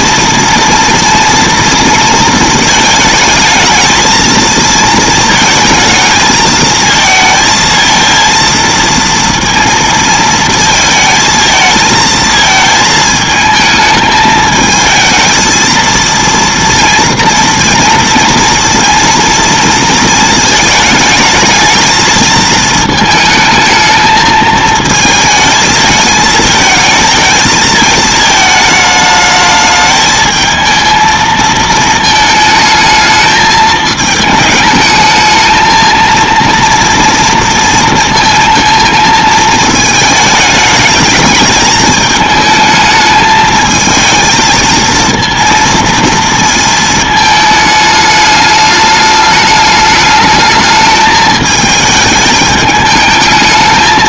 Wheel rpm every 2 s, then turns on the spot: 230, 220, 220, 220, 230, 220, 220, 220, 230, 230, 220, 220, 220, 220, 220, 220, 220, 220, 230, 220, 210, 220, 220, 220, 210, 220, 210.
none